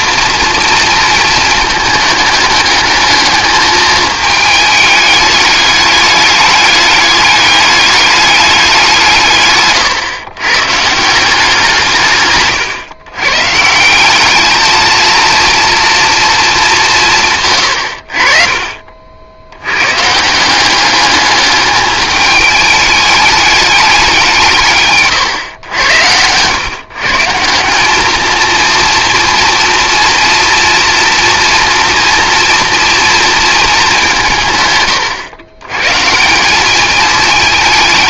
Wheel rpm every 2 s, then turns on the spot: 230, 210, 210, 210, 180, 150, 120, 220, 190, 50, 190, 210, 130, 130, 230, 230, 230, 130, 210.
none